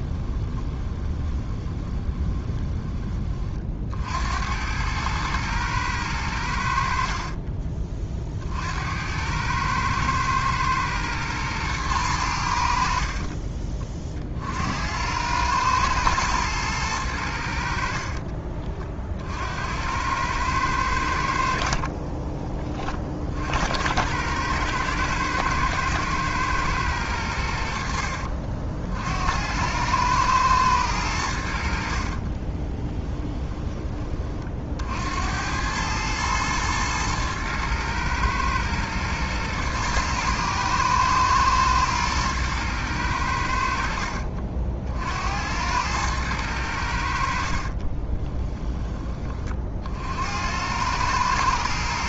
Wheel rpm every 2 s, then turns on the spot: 20, 20, 100, 60, 80, 110, 70, 80, 100, 50, 90, 40, 110, 110, 70, 100, 30, 70, 110, 110, 120, 100, 60, 80, 20, 100.
0-2 32-34